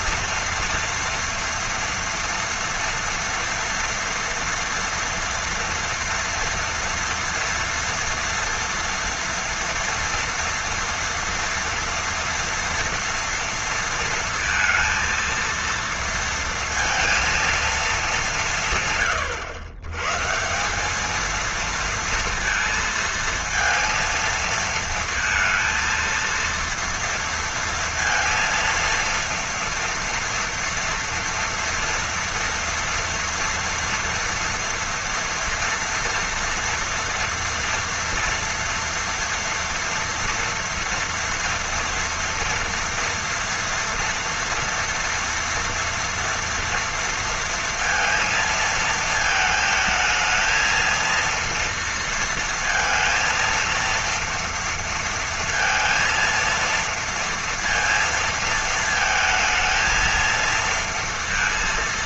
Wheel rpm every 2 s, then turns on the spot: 230, 230, 230, 230, 230, 240, 230, 230, 230, 150, 190, 230, 220, 230, 230, 230, 230, 230, 230, 230, 230, 230, 230, 230, 230, 220, 230, 230, 230, 220, 230.
none